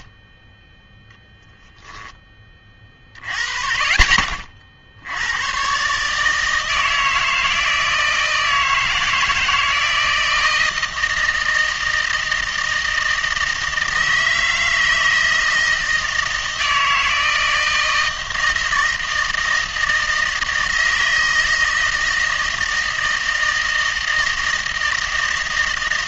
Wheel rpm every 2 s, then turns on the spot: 0, 30, 60, 160, 160, 160, 160, 160, 160, 160, 160, 160, 160.
none